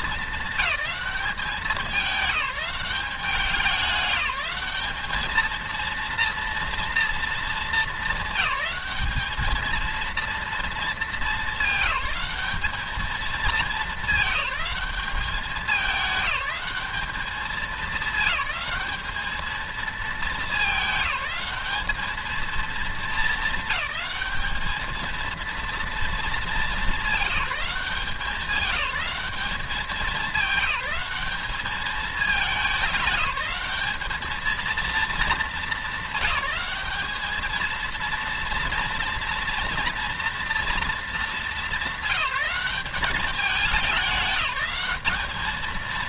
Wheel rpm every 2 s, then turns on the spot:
210, 200, 210, 230, 200, 220, 210, 200, 200, 210, 210, 210, 210, 210, 190, 190, 210, 230, 210, 230, 230, 210, 210.
none